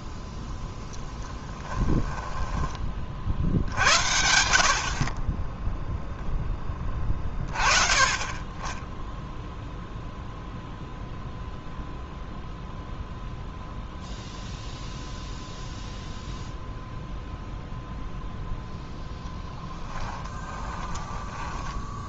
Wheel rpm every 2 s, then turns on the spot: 0, 20, 60, 10, 20, 0, 0, 0, 0, 0, 10.
20-22